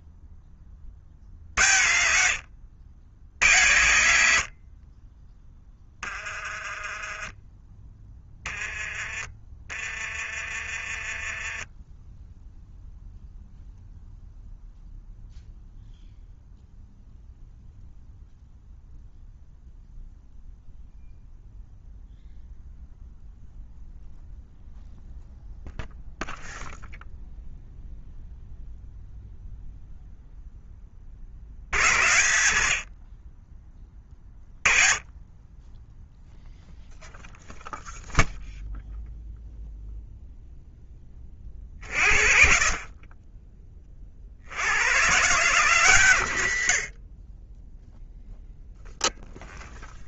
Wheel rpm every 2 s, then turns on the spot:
40, 90, 20, 10, 30, 20, 0, 0, 0, 0, 0, 0, 0, 0, 0, 50, 40, 40, 0, 0, 10, 50, 120, 40, 0.
8-10